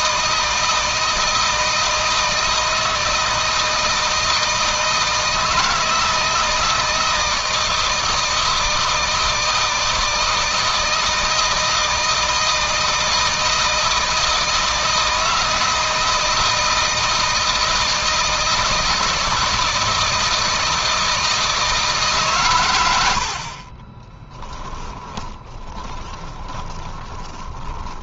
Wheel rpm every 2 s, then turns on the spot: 160, 160, 160, 160, 160, 160, 160, 160, 160, 160, 160, 120, 20, 20.
22-28